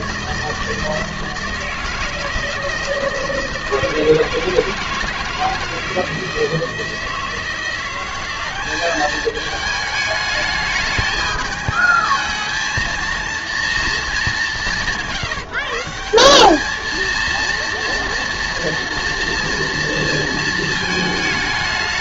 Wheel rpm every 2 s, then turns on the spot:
160, 160, 160, 160, 200, 210, 220, 170, 220, 240, 220.
none